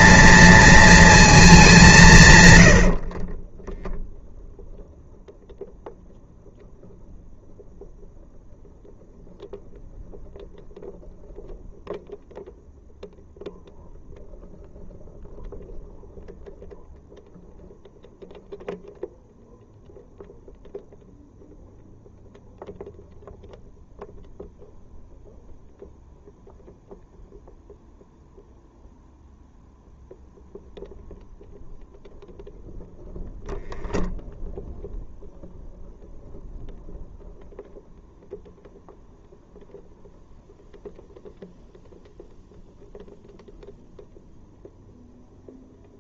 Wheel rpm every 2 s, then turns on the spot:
230, 90, 0, 0, 0, 0, 0, 0, 0, 0, 0, 0, 0, 0, 0, 0, 0, 0, 0, 0, 0, 0, 0.
none